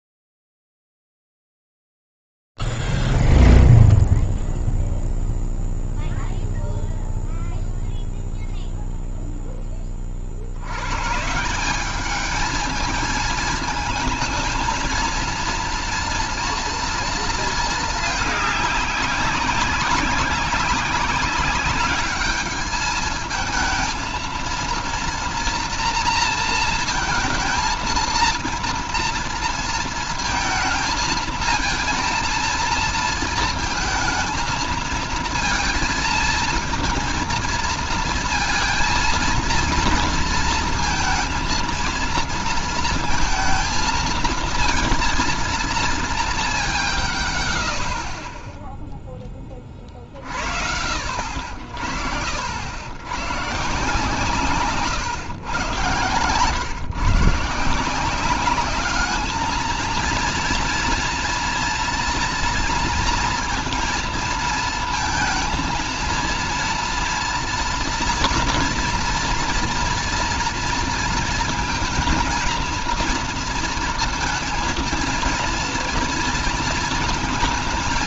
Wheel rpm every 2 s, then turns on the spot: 0, 0, 0, 0, 0, 50, 210, 220, 230, 210, 190, 210, 230, 230, 230, 220, 230, 230, 230, 230, 230, 230, 230, 160, 10, 80, 100, 130, 140, 200, 230, 230, 220, 230, 230, 230, 230, 230, 230.
none